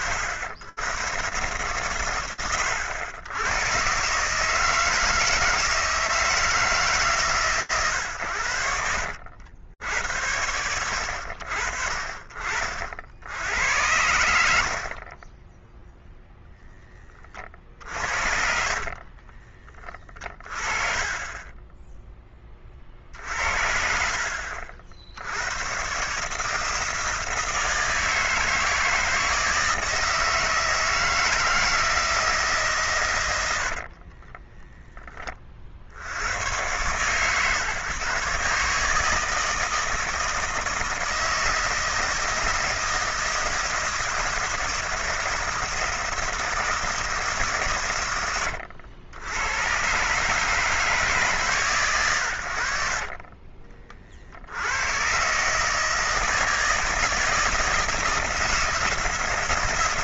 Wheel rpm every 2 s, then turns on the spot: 80, 100, 160, 160, 80, 90, 70, 50, 20, 40, 30, 40, 60, 160, 160, 160, 120, 10, 120, 150, 160, 160, 160, 160, 90, 140, 60, 100, 160, 160.
18-20